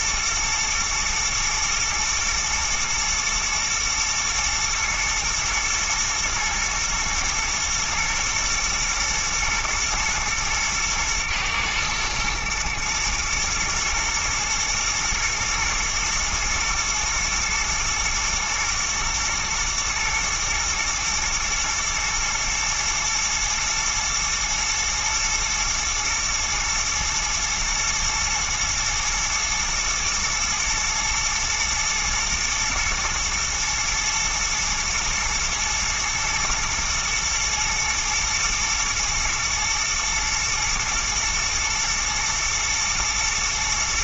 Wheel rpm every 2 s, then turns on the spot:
120, 110, 110, 110, 110, 110, 120, 120, 120, 120, 110, 110, 120, 110, 120, 110, 120, 110, 110, 110, 110, 110.
none